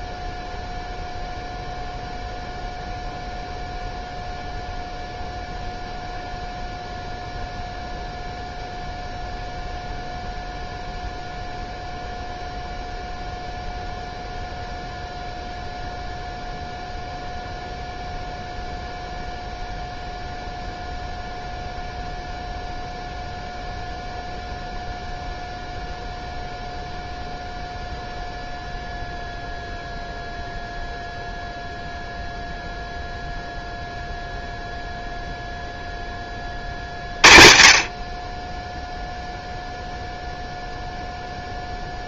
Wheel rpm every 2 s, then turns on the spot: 0, 0, 0, 0, 0, 0, 0, 0, 0, 0, 0, 0, 0, 0, 0, 0, 0, 0, 40, 10, 0.
none